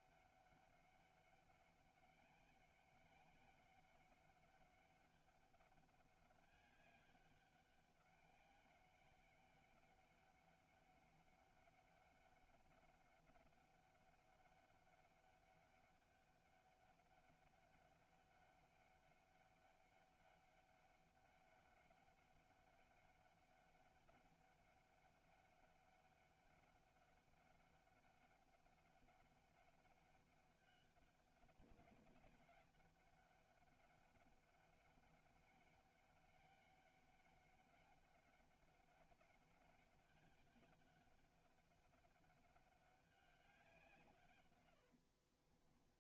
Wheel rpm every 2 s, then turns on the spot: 200, 190, 200, 200, 200, 200, 200, 200, 200, 200, 200, 200, 200, 200, 200, 190, 200, 200, 200, 200, 190, 200, 100.
44-46